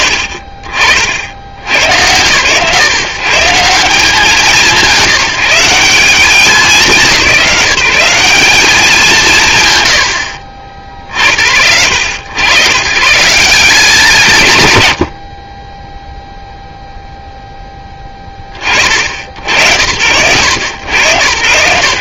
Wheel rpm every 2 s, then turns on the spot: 50, 120, 170, 170, 200, 60, 130, 60, 0, 40, 90.
none